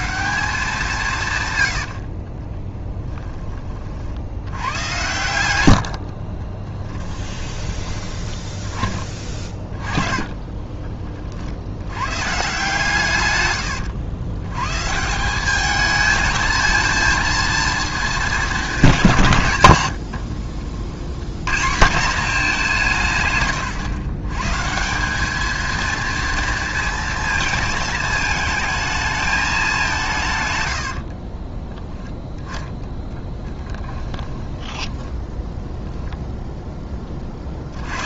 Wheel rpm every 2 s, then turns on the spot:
180, 20, 100, 10, 20, 30, 150, 140, 220, 180, 80, 170, 170, 230, 220, 80, 10, 10, 10.
6-8 30-36